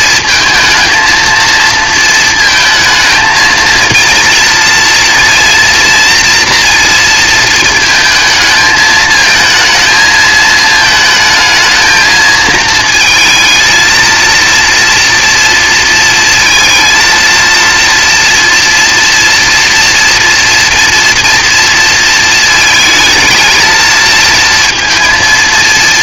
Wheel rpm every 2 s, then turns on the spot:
230, 220, 230, 230, 220, 220, 220, 230, 230, 230, 230, 220, 220.
none